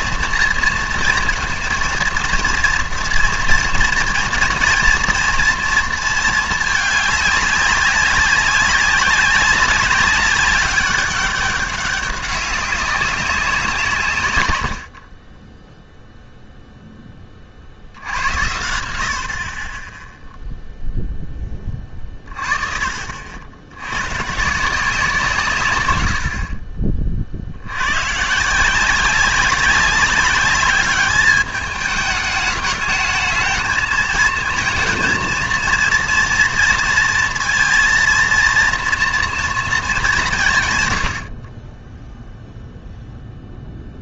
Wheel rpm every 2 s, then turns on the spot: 230, 230, 230, 220, 190, 200, 200, 100, 0, 90, 0, 40, 160, 40, 160, 210, 210, 230, 230, 230, 140, 0.
none